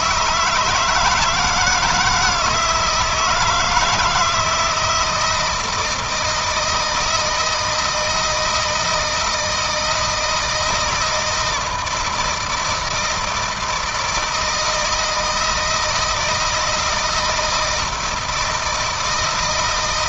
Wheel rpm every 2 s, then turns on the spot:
160, 160, 160, 160, 170, 160, 160, 160, 160, 160.
none